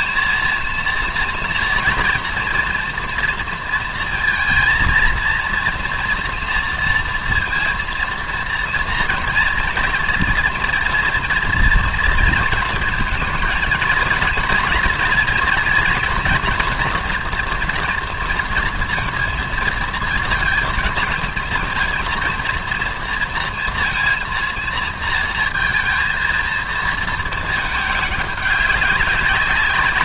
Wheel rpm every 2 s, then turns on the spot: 230, 230, 230, 230, 230, 230, 230, 230, 240, 230, 230, 230, 230, 230, 200.
none